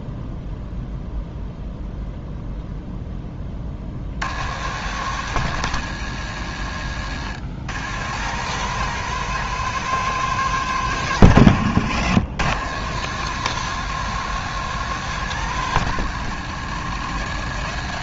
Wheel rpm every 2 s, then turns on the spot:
0, 0, 100, 90, 120, 120, 100, 130, 100.
none